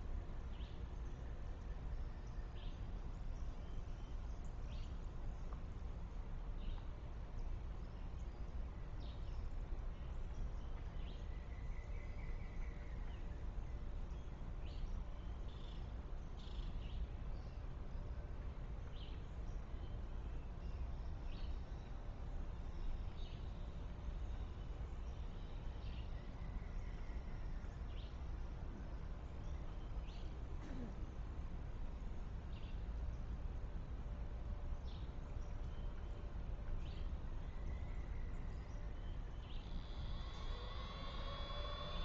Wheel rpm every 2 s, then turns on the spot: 0, 0, 0, 0, 0, 0, 0, 0, 0, 0, 0, 0, 0, 0, 0, 0, 0, 0, 0, 0, 0.
none